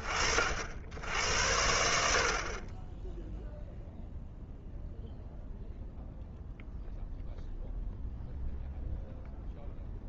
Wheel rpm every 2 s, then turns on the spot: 100, 0, 0, 0, 0.
none